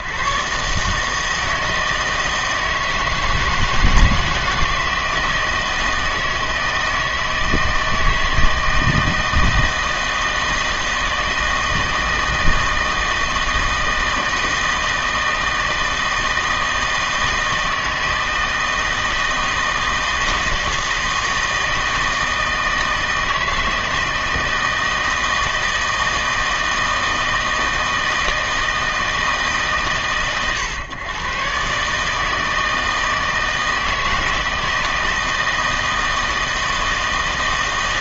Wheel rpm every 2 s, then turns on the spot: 140, 160, 160, 160, 160, 160, 160, 160, 160, 160, 160, 160, 160, 160, 160, 120, 160, 160, 160.
none